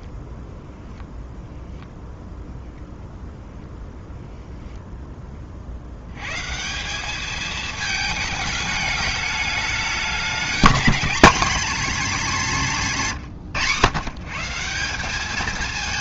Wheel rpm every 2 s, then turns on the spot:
0, 0, 0, 140, 220, 220, 210, 160.
none